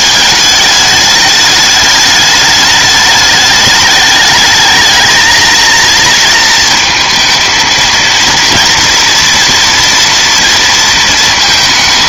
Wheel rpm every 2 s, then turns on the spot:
210, 210, 220, 220, 230, 230.
none